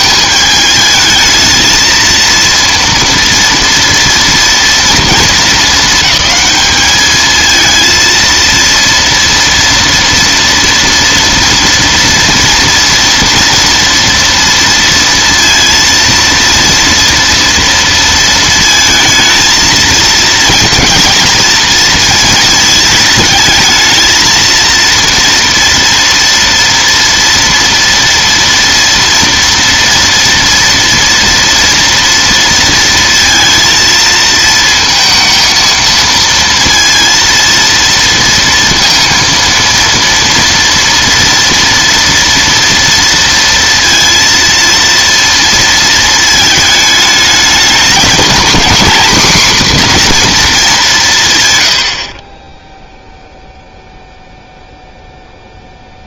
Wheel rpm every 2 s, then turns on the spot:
220, 230, 230, 210, 230, 230, 230, 230, 230, 230, 230, 220, 230, 230, 230, 230, 230, 230, 230, 230, 230, 230, 230, 220, 240, 220, 10, 0.
none